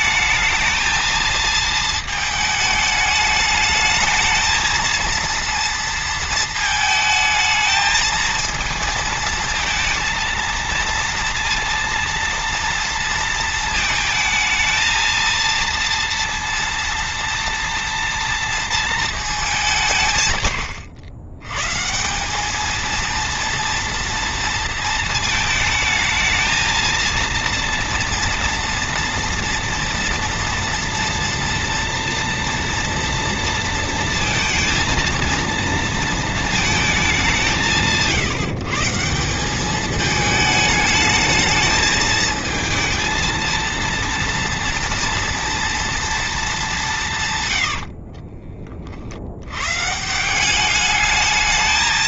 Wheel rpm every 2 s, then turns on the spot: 220, 220, 220, 220, 220, 230, 230, 230, 230, 230, 110, 210, 230, 220, 230, 230, 230, 230, 220, 160, 220, 220, 230, 210, 40, 180.
none